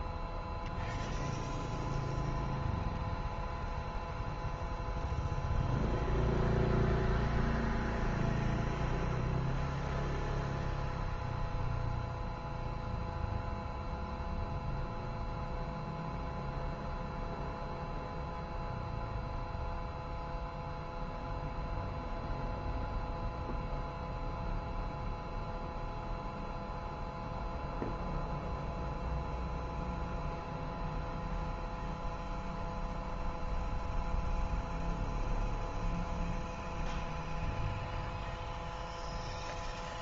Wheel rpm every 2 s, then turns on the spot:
10, 0, 0, 0, 0, 0, 0, 0, 0, 0, 0, 0, 0, 0, 0, 0, 0, 0, 0, 0.
none